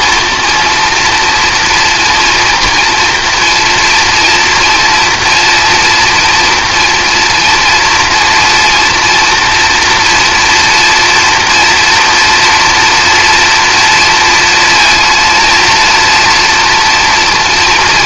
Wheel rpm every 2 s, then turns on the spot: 230, 230, 240, 230, 230, 230, 240, 230, 230.
none